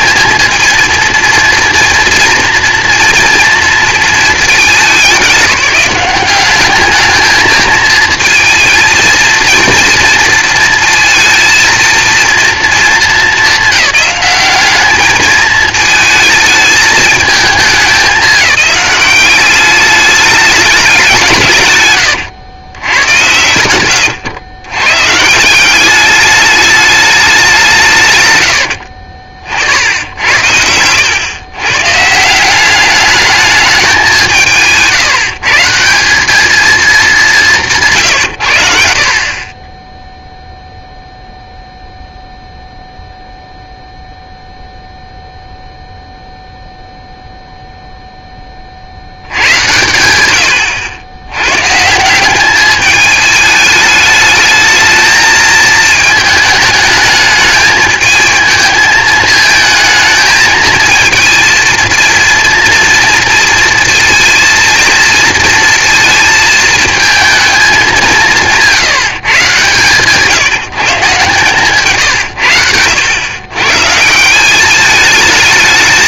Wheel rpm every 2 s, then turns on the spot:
220, 230, 210, 200, 230, 230, 230, 200, 220, 190, 210, 110, 110, 210, 80, 90, 190, 150, 220, 80, 0, 0, 0, 0, 30, 90, 210, 220, 210, 220, 220, 230, 230, 220, 170, 160, 100, 200.
28-30